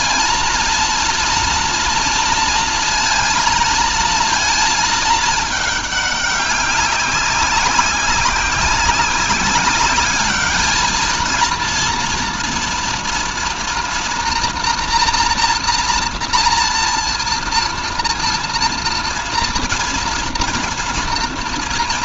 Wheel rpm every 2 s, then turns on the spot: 230, 230, 220, 200, 190, 210, 230, 230, 230, 230, 230.
none